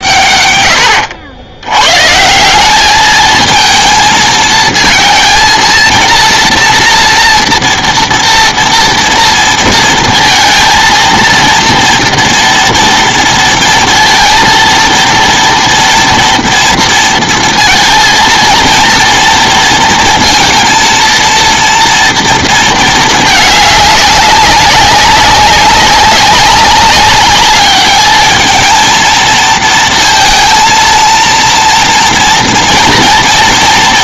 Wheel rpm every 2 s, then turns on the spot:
140, 150, 220, 230, 230, 230, 230, 230, 240, 230, 230, 230, 200, 200, 220, 230, 230.
none